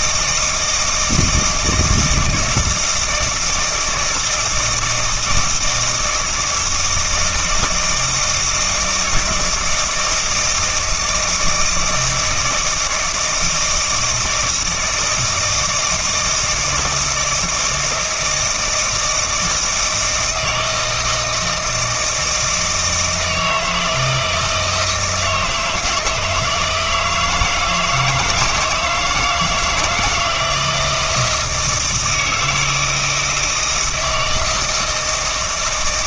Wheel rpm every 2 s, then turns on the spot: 160, 160, 160, 160, 160, 160, 160, 160, 160, 160, 160, 160, 160, 160, 160, 170, 160, 160.
none